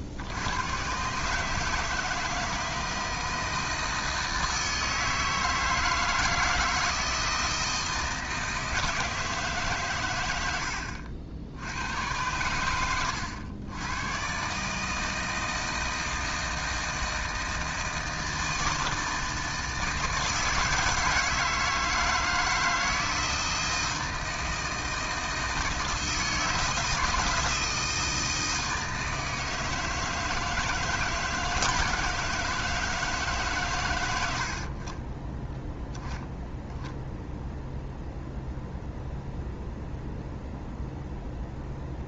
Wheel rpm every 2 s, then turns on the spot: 120, 160, 160, 160, 160, 80, 100, 140, 160, 160, 160, 160, 160, 160, 160, 160, 160, 60, 0, 0, 0.
none